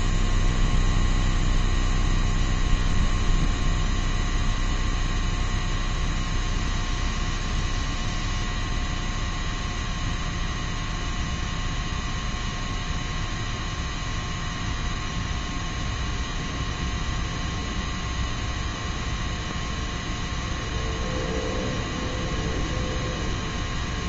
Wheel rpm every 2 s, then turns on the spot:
0, 0, 0, 0, 0, 0, 0, 0, 0, 0, 0, 0.
none